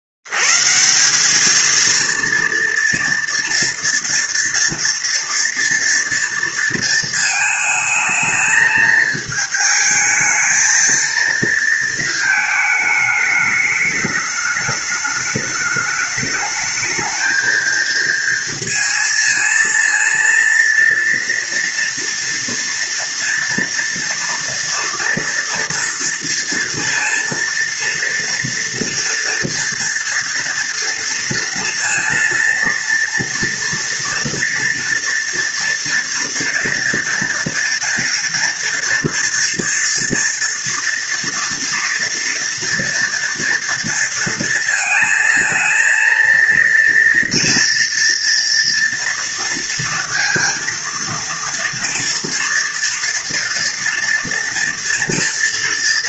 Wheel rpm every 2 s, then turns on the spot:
70, 230, 230, 230, 220, 220, 220, 210, 210, 220, 230, 230, 230, 230, 230, 230, 230, 230, 230, 230, 240, 230, 230, 230, 240, 230, 230, 230.
none